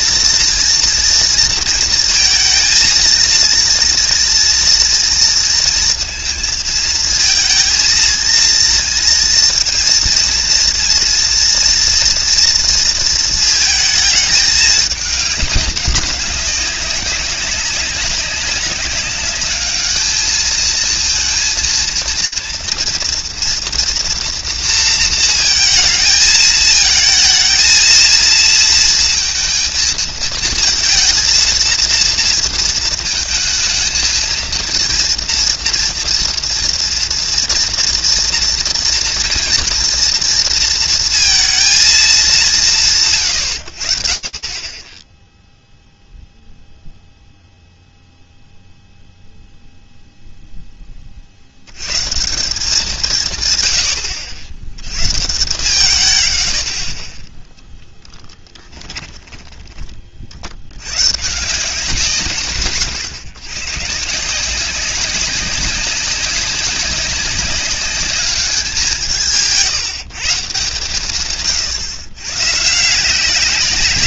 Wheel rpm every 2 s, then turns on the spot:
240, 220, 230, 230, 230, 230, 230, 210, 190, 190, 220, 230, 230, 220, 230, 230, 230, 230, 230, 240, 230, 130, 10, 0, 0, 30, 170, 120, 20, 10, 110, 140, 190, 200, 180, 160, 160.
58-60